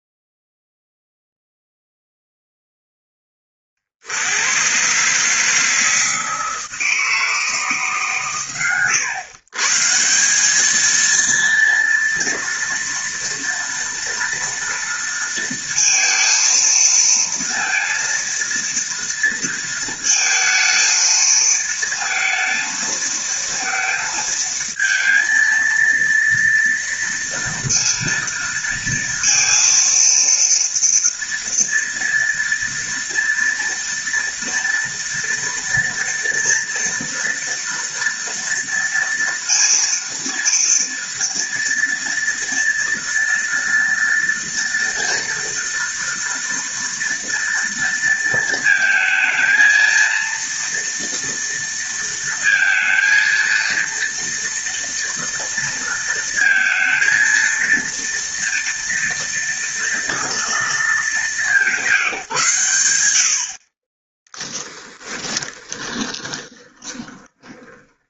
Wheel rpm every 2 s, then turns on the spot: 0, 0, 130, 160, 100, 220, 230, 230, 230, 230, 220, 220, 230, 230, 230, 230, 230, 230, 230, 230, 230, 230, 240, 230, 220, 230, 230, 230, 230, 230, 220, 110, 10, 20.
64-68